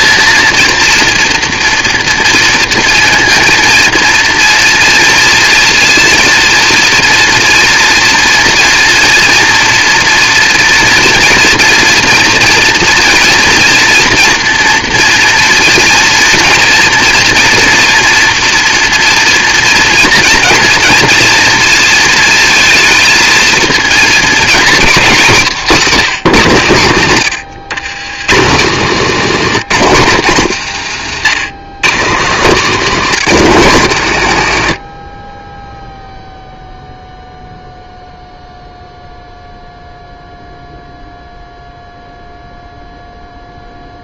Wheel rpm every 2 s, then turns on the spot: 230, 230, 230, 230, 230, 230, 230, 230, 240, 230, 230, 220, 220, 170, 160, 140, 200, 110, 0, 0, 0, 0.
none